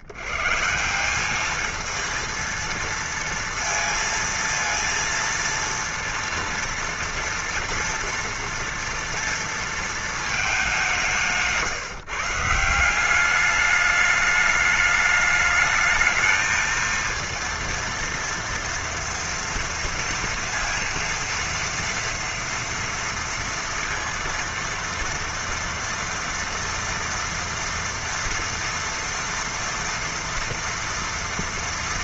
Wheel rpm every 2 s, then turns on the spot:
110, 230, 230, 230, 230, 220, 150, 210, 220, 230, 230, 230, 230, 230, 230, 230.
none